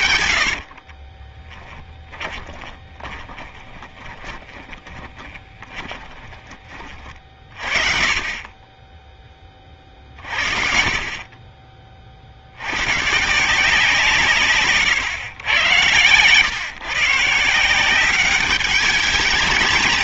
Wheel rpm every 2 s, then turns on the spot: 80, 10, 10, 30, 20, 50, 80, 140, 120, 200.
0-6